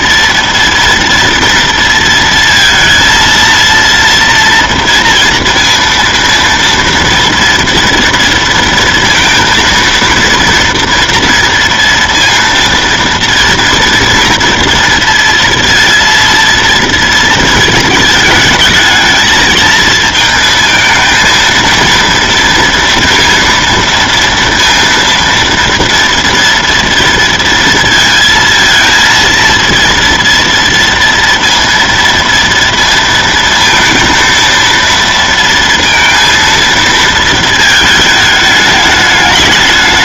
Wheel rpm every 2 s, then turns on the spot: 230, 230, 230, 230, 230, 230, 230, 230, 230, 220, 220, 230, 230, 230, 230, 230, 230, 230, 230, 210.
none